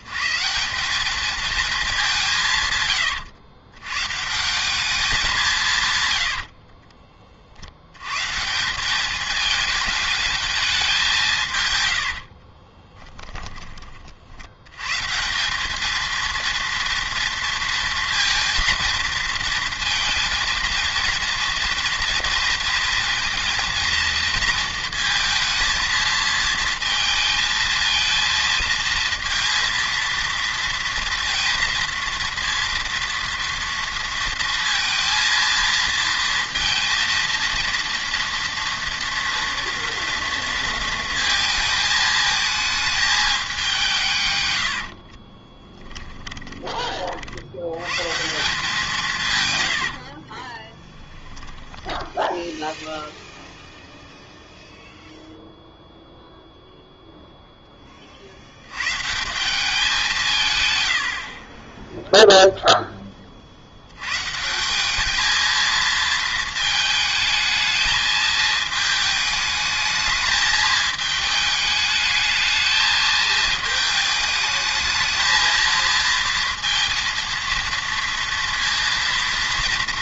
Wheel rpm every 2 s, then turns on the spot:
170, 110, 190, 40, 180, 210, 40, 90, 230, 230, 230, 230, 230, 230, 230, 230, 230, 230, 230, 230, 230, 220, 80, 20, 180, 20, 0, 0, 0, 90, 130, 10, 180, 220, 220, 210, 220, 220, 230, 230.
2-4 6-8 12-14 44-46 50-52